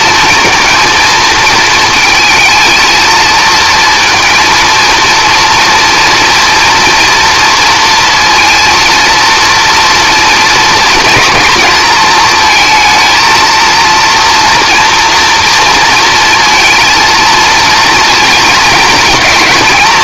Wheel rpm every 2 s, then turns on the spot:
230, 230, 230, 240, 230, 230, 220, 230, 230, 220.
none